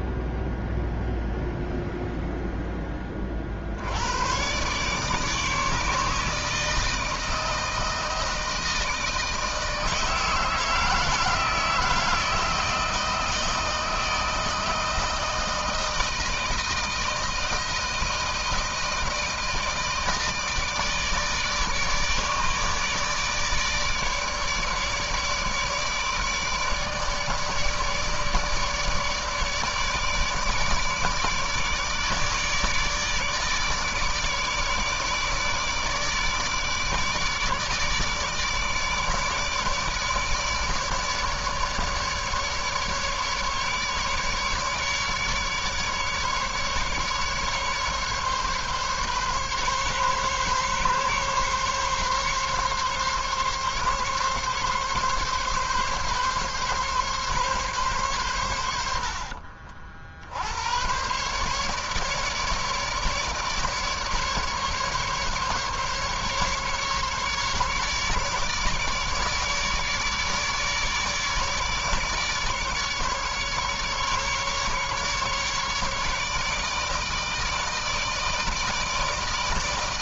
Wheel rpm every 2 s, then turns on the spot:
0, 0, 120, 160, 160, 160, 160, 160, 160, 160, 160, 150, 150, 150, 150, 150, 150, 150, 150, 150, 150, 150, 150, 150, 140, 140, 140, 140, 140, 100, 80, 150, 150, 140, 150, 150, 150, 140, 150, 160.
none